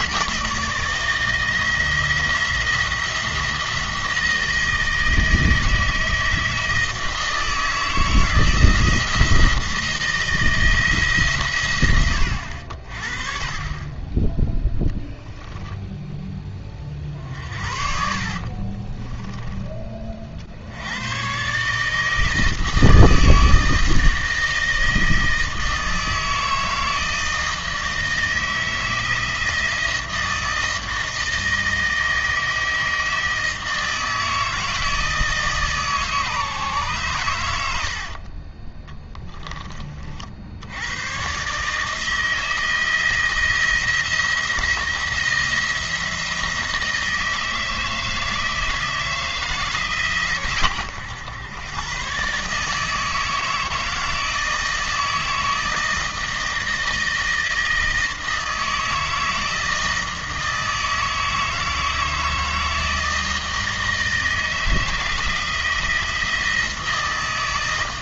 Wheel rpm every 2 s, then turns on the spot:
160, 170, 160, 160, 170, 150, 50, 0, 30, 40, 70, 160, 160, 160, 160, 160, 160, 160, 130, 10, 100, 160, 170, 160, 160, 120, 160, 160, 160, 160, 160, 160, 160, 160.
18-20 38-40